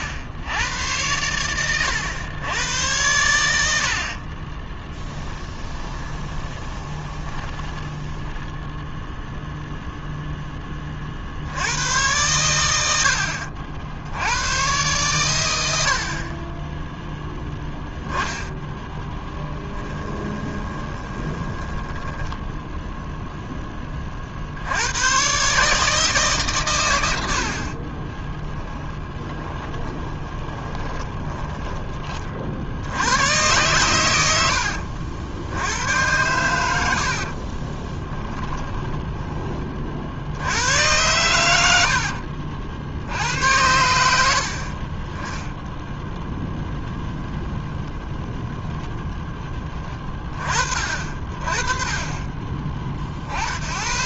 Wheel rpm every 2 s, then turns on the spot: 100, 100, 20, 30, 10, 30, 90, 120, 10, 10, 20, 0, 80, 120, 20, 20, 70, 70, 90, 20, 90, 60, 40, 0, 0, 40, 30.
4-8 18-22 28-32 38-40